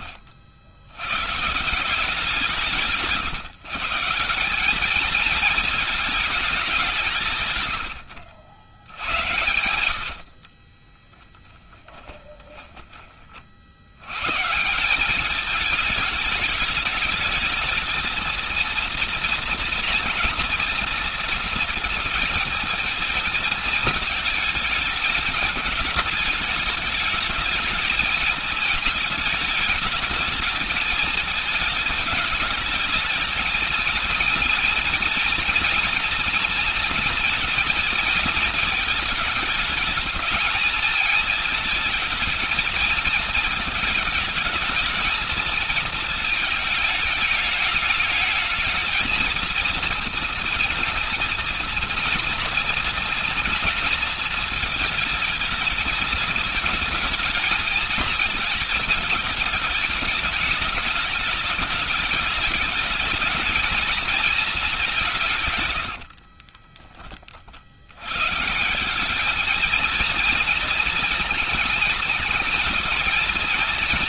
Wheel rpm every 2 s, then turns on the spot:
70, 140, 210, 150, 90, 20, 30, 200, 210, 230, 230, 220, 210, 210, 220, 220, 220, 230, 230, 210, 220, 220, 220, 210, 220, 230, 230, 220, 220, 220, 210, 220, 190, 20, 170, 230, 220.
10-12